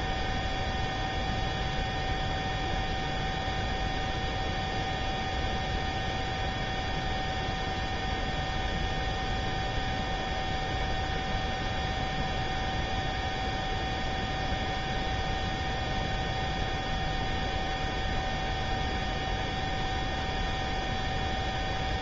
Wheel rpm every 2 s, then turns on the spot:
0, 0, 0, 0, 0, 0, 0, 0, 0, 0, 0.
none